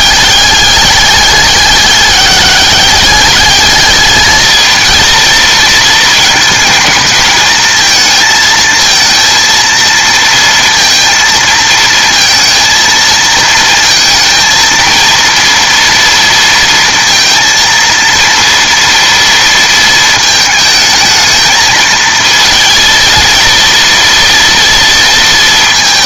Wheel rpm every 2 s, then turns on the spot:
210, 200, 220, 220, 230, 230, 230, 230, 230, 230, 220, 230, 230.
none